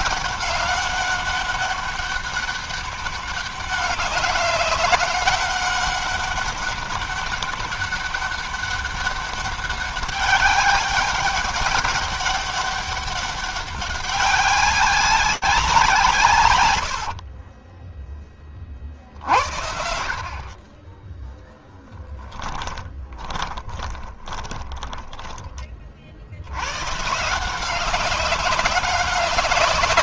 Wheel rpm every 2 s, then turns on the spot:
200, 200, 200, 200, 200, 200, 200, 190, 100, 20, 40, 10, 20, 100, 190.
16-18 22-26